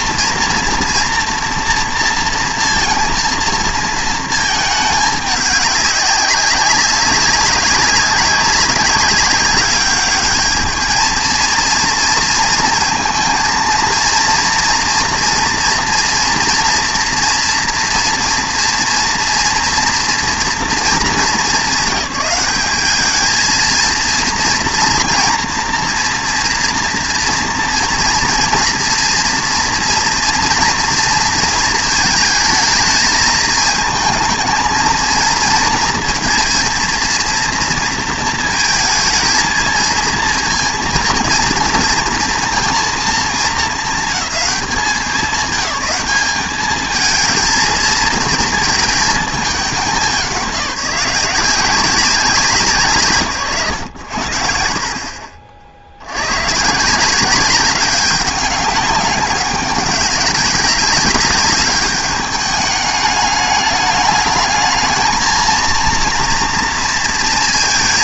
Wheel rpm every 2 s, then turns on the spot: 240, 230, 220, 200, 200, 220, 230, 240, 240, 230, 230, 200, 230, 230, 230, 230, 220, 220, 230, 220, 230, 230, 210, 210, 230, 180, 170, 60, 140, 200, 190, 210, 220, 230.
none